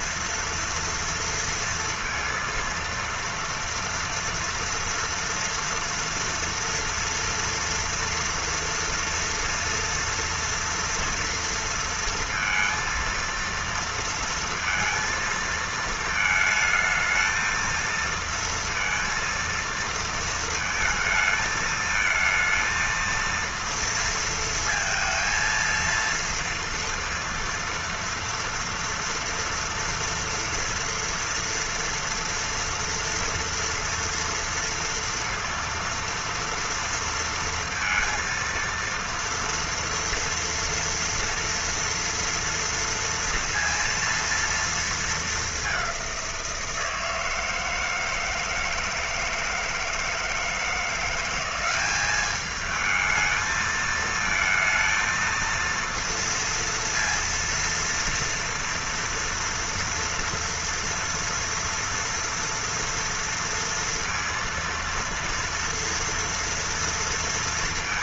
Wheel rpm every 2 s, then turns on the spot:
230, 230, 230, 230, 230, 230, 230, 230, 220, 230, 220, 230, 230, 230, 230, 230, 230, 230, 230, 230, 230, 230, 230, 170, 160, 170, 210, 230, 230, 230, 230, 230, 230, 230.
none